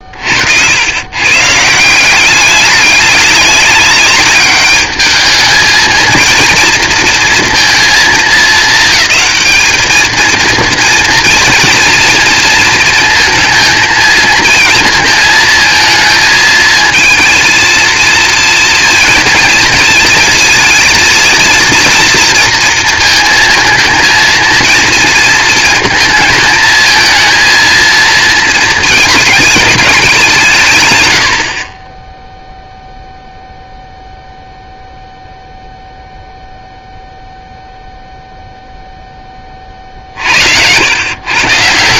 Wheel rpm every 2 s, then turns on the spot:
90, 200, 200, 230, 220, 230, 230, 230, 230, 230, 230, 230, 220, 220, 220, 140, 0, 0, 0, 0, 80.
none